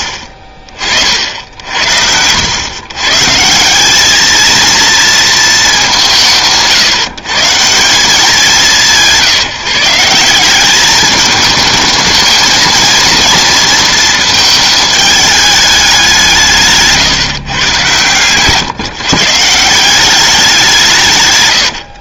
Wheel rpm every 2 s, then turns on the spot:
30, 100, 230, 150, 180, 190, 220, 220, 160, 140, 170.
none